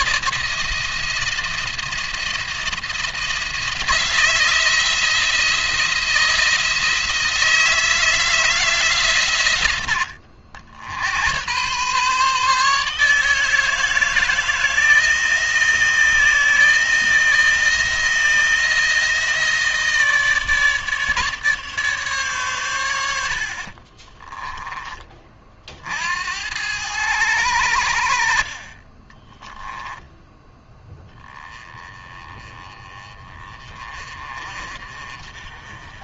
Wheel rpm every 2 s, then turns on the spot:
160, 170, 170, 160, 160, 70, 150, 160, 160, 170, 150, 120, 20, 90, 40, 10, 20, 40.
none